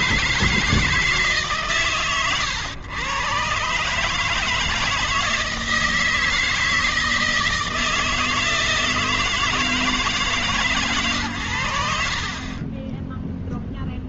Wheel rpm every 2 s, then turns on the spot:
160, 100, 150, 160, 160, 130, 40.
none